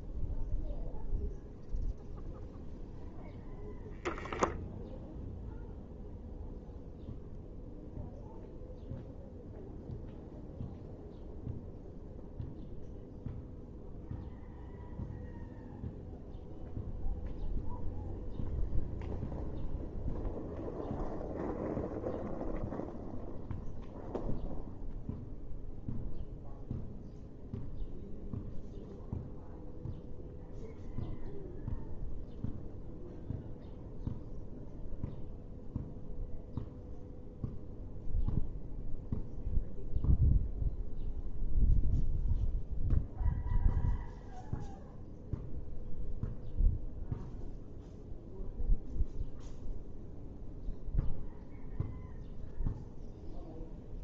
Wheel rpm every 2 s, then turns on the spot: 0, 0, 0, 0, 0, 0, 0, 0, 0, 0, 0, 0, 0, 0, 0, 0, 0, 0, 0, 0, 0, 0, 0, 0, 0, 0, 0.
none